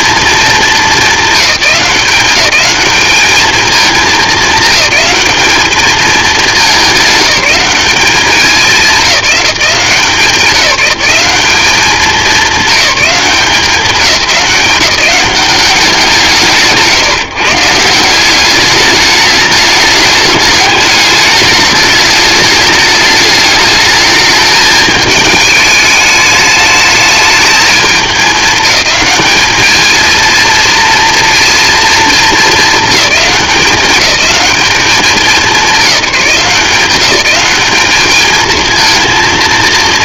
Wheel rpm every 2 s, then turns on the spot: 220, 210, 210, 200, 210, 190, 200, 190, 160, 210, 210, 210, 220, 210, 210, 230, 210, 200, 180, 230.
none